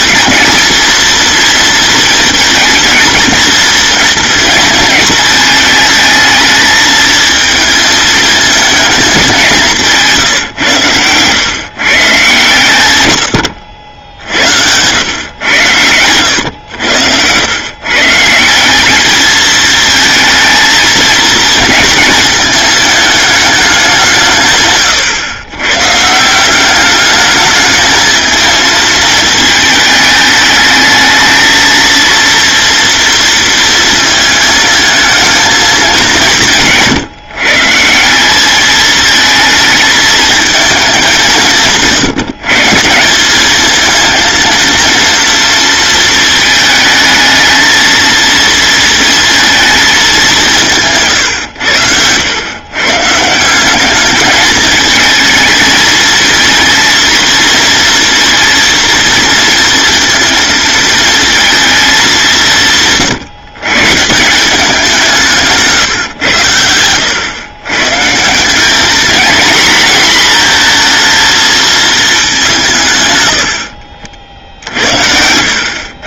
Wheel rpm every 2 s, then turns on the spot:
230, 230, 220, 220, 220, 100, 110, 110, 90, 200, 230, 220, 140, 200, 220, 220, 230, 220, 150, 220, 200, 160, 230, 220, 230, 150, 130, 220, 230, 230, 230, 150, 180, 100, 220, 230, 130, 60.
66-68 74-76